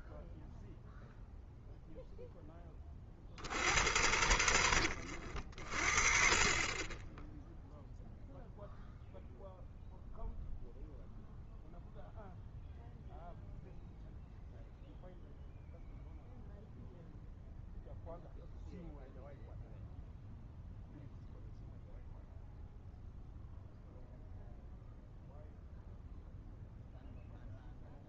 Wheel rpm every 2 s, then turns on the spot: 0, 50, 80, 20, 0, 0, 0, 0, 0, 0, 0, 0, 0, 0.
none